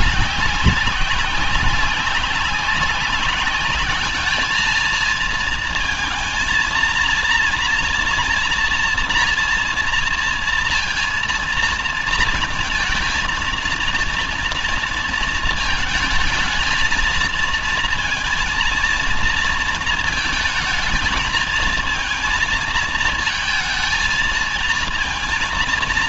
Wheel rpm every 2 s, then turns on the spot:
190, 190, 210, 230, 230, 230, 230, 230, 220, 230, 220, 220, 230.
none